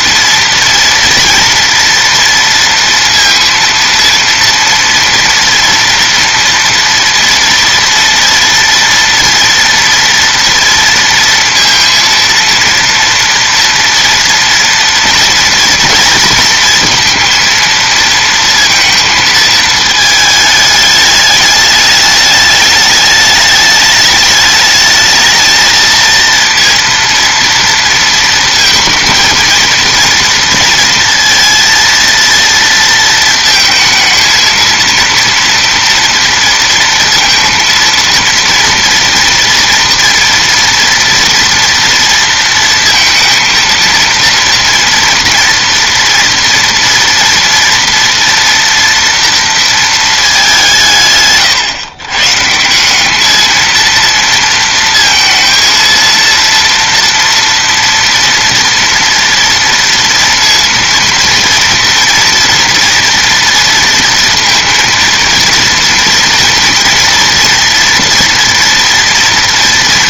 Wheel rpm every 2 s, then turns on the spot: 230, 230, 230, 230, 230, 230, 230, 230, 230, 230, 220, 210, 210, 230, 230, 230, 230, 230, 230, 230, 240, 230, 230, 230, 230, 210, 130, 230, 230, 230, 230, 230, 230, 230, 230.
none